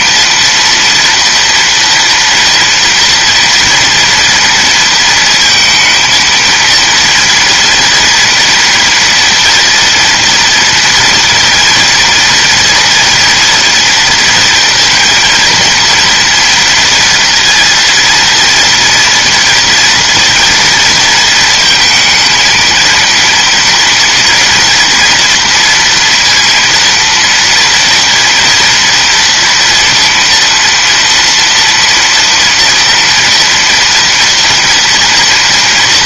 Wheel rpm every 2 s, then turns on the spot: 230, 230, 230, 230, 230, 230, 240, 230, 230, 230, 230, 230, 230, 230, 230, 230, 230, 230.
none